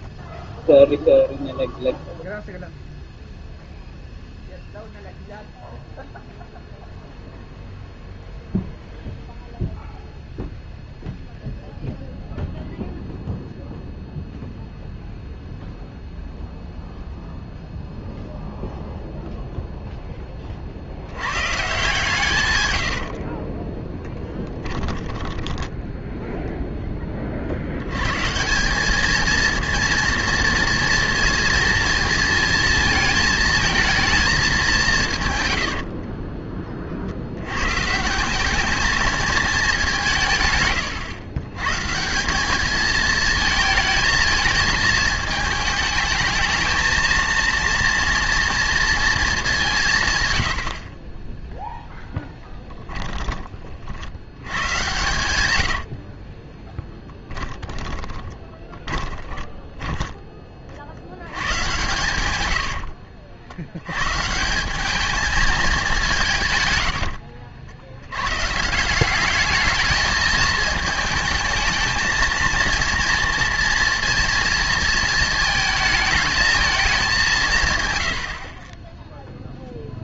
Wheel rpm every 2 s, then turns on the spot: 0, 0, 0, 0, 0, 0, 0, 0, 0, 0, 60, 80, 10, 10, 190, 230, 220, 170, 50, 220, 130, 220, 220, 220, 230, 40, 20, 110, 10, 20, 60, 80, 210, 110, 170, 220, 230, 230, 210, 20.
22-26 52-60 62-64 66-68 78-80